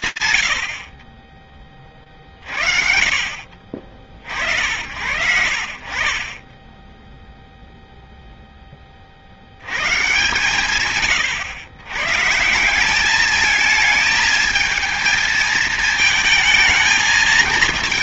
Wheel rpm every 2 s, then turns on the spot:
30, 80, 30, 0, 120, 130, 220, 220, 220.
none